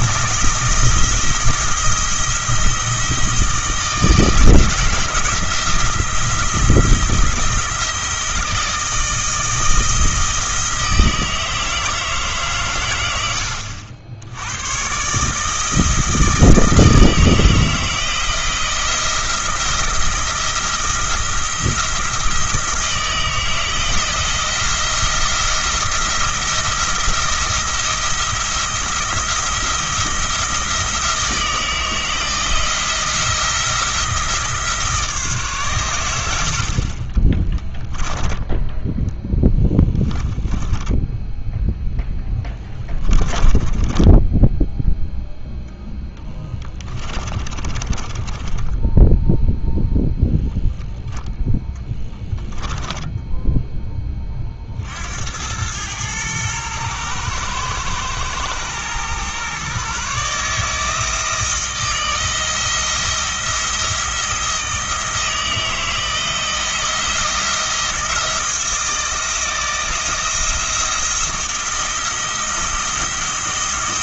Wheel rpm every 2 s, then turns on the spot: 170, 170, 170, 170, 160, 160, 140, 90, 160, 170, 170, 160, 170, 170, 170, 170, 160, 160, 50, 10, 10, 10, 10, 20, 10, 0, 10, 50, 110, 110, 150, 160, 160, 170, 160, 170, 170.
38-44 46-50 52-54